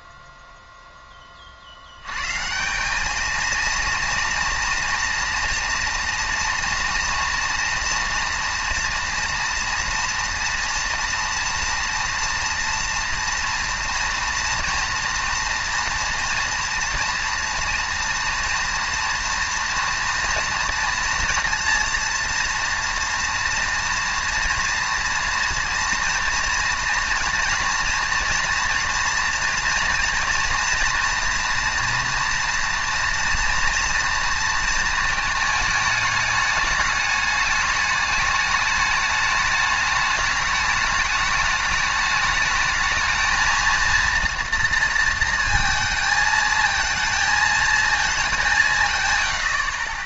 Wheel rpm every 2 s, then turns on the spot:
0, 160, 230, 230, 230, 230, 240, 230, 230, 230, 230, 230, 230, 230, 230, 240, 230, 230, 210, 210, 210, 220, 230, 220, 170.
none